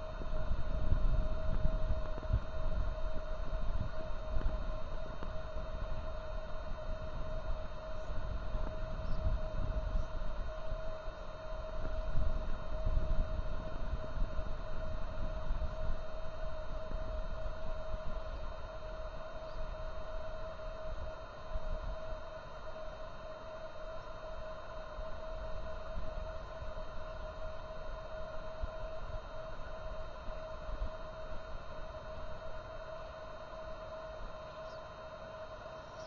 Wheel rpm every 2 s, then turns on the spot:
0, 0, 0, 0, 0, 0, 0, 0, 0, 0, 0, 0, 0, 0, 0, 0, 0, 0.
none